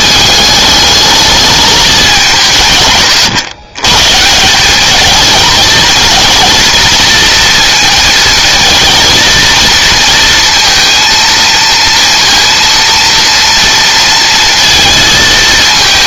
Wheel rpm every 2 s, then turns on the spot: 210, 140, 200, 230, 230, 230, 230, 230.
none